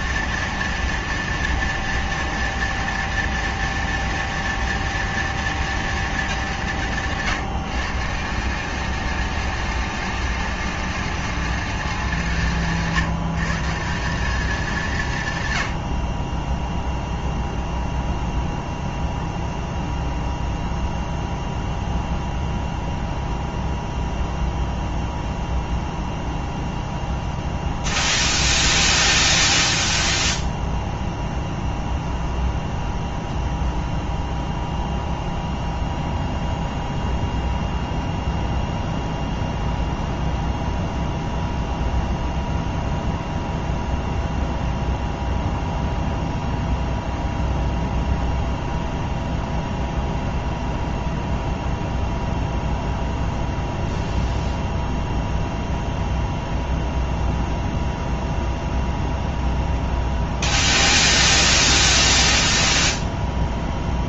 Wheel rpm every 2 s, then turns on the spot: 230, 230, 230, 190, 180, 210, 180, 190, 10, 0, 0, 0, 0, 0, 0, 0, 0, 0, 0, 0, 0, 0, 0, 0, 0, 0, 0, 0, 0, 0, 0, 0.
none